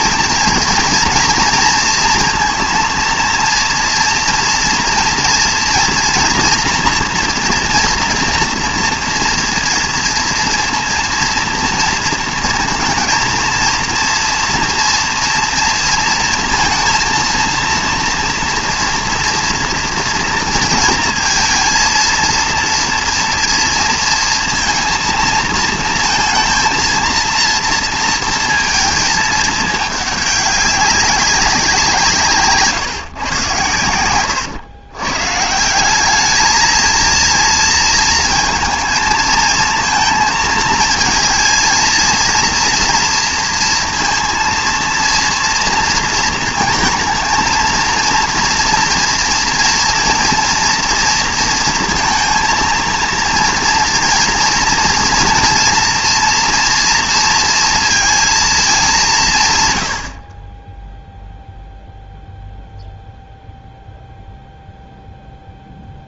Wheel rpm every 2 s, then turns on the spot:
230, 230, 240, 230, 230, 230, 230, 230, 230, 240, 230, 230, 230, 220, 230, 200, 150, 120, 220, 220, 220, 230, 230, 230, 230, 230, 230, 240, 230, 200, 10, 0, 0.
none